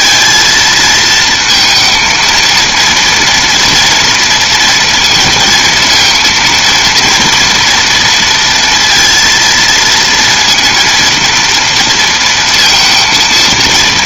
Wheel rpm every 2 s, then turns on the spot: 220, 230, 230, 230, 230, 230, 230.
none